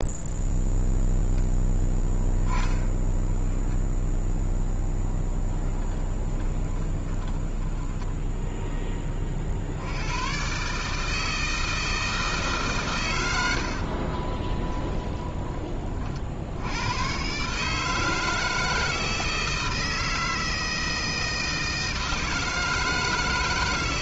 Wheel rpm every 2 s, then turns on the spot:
0, 0, 0, 20, 10, 150, 120, 20, 100, 160, 160, 160.
6-8 14-16